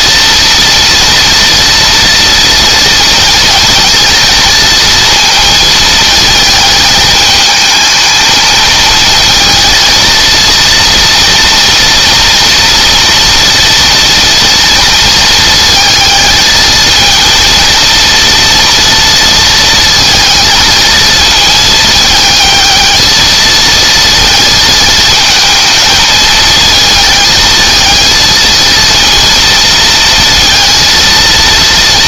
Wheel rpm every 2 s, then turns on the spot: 230, 230, 230, 220, 230, 230, 240, 230, 220, 230, 230, 220, 220, 220, 230, 230.
none